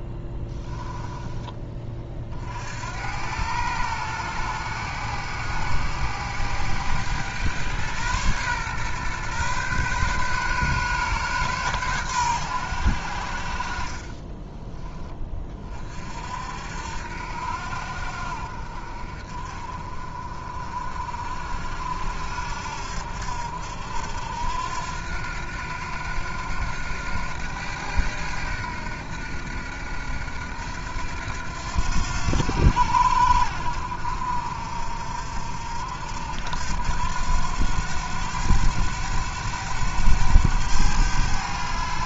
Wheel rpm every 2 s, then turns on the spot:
10, 70, 100, 110, 120, 130, 90, 20, 70, 50, 40, 70, 80, 90, 80, 80, 80, 60, 80, 100, 100.
0-2